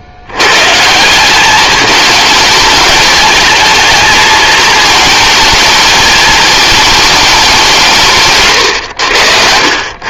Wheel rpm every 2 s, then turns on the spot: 150, 210, 220, 220, 120.
none